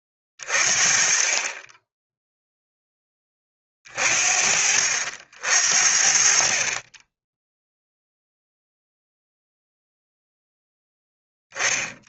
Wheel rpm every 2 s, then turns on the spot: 40, 10, 60, 30, 0, 0.
none